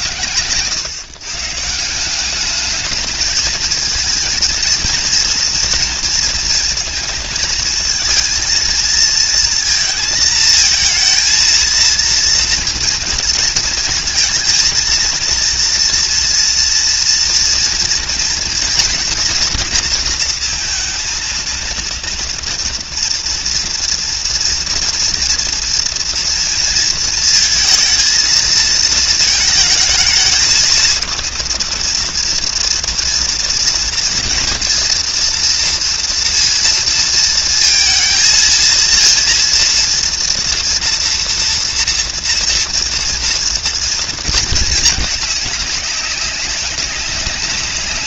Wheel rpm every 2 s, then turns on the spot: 120, 210, 230, 230, 230, 220, 230, 220, 230, 220, 230, 230, 230, 230, 230, 220, 230, 230, 230, 230, 240, 230, 220, 200.
0-2